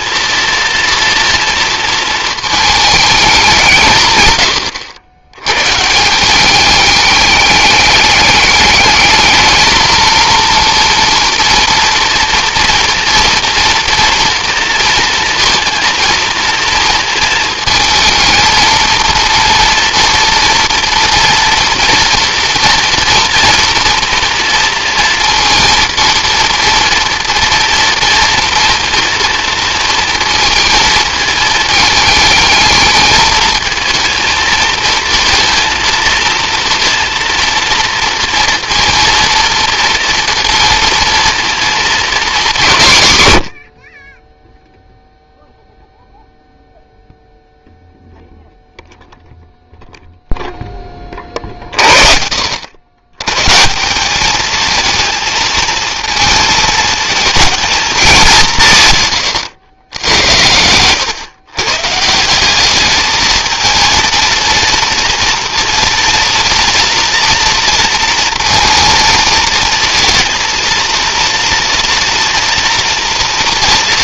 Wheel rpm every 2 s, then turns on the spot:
230, 210, 90, 210, 220, 230, 240, 230, 230, 230, 230, 230, 230, 230, 230, 220, 220, 230, 230, 230, 230, 180, 0, 0, 0, 20, 100, 230, 220, 140, 110, 210, 230, 230, 230, 230, 230.
none